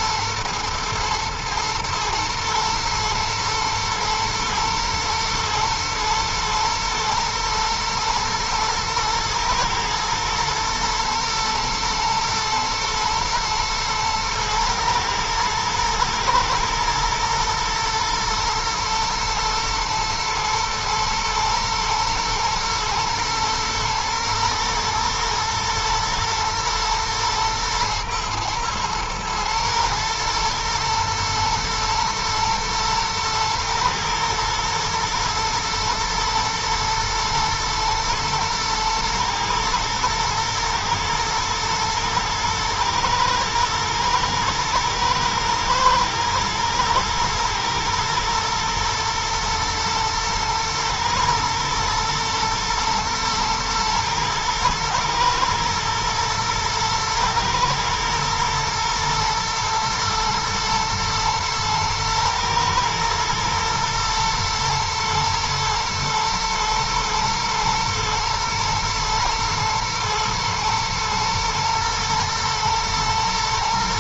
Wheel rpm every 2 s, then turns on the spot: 110, 120, 110, 110, 110, 110, 110, 110, 120, 110, 110, 110, 110, 120, 110, 110, 110, 120, 110, 120, 110, 110, 110, 120, 110, 110, 120, 110, 110, 110, 110, 110, 120, 120, 110, 110, 110.
none